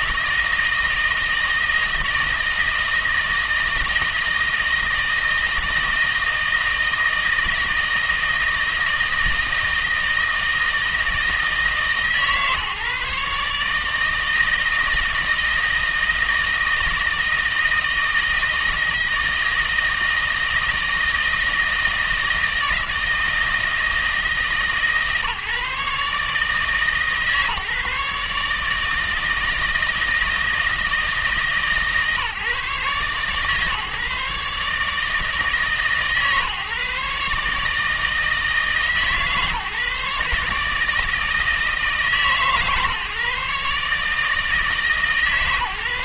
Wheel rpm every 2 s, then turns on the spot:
160, 160, 160, 160, 160, 160, 150, 160, 160, 160, 160, 160, 150, 150, 160, 160, 130, 150, 150, 150, 150, 140, 160.
none